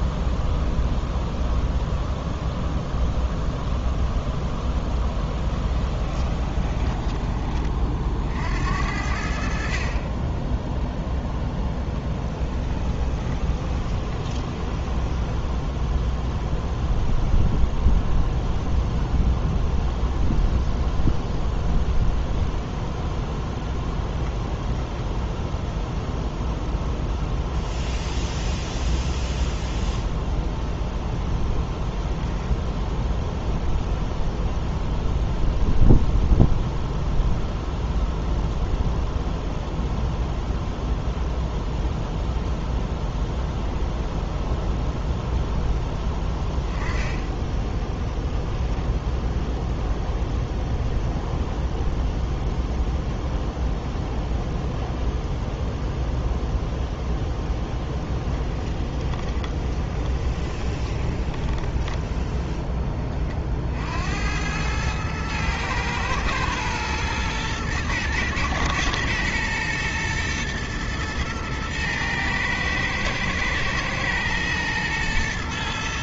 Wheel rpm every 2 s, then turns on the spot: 0, 0, 10, 30, 60, 10, 20, 10, 0, 0, 0, 0, 10, 0, 0, 0, 0, 0, 0, 0, 0, 0, 0, 10, 0, 0, 0, 0, 0, 10, 20, 10, 100, 120, 110, 110, 110, 120.
6-8 12-16 58-62